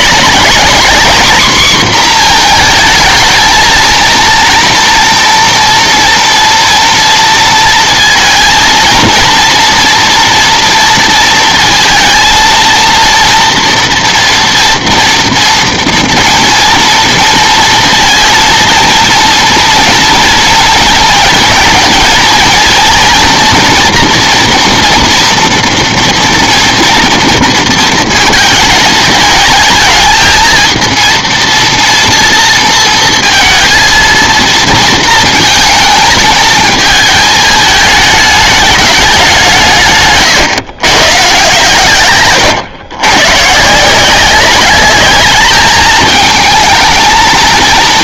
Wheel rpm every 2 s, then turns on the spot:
210, 230, 230, 230, 220, 230, 230, 230, 230, 230, 230, 230, 240, 230, 220, 220, 230, 230, 220, 210, 120, 120, 190, 220.
none